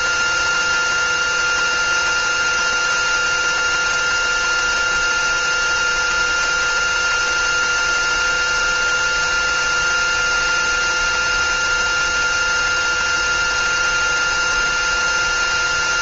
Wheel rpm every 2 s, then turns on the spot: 360, 360, 360, 360, 370, 360, 370, 360.
none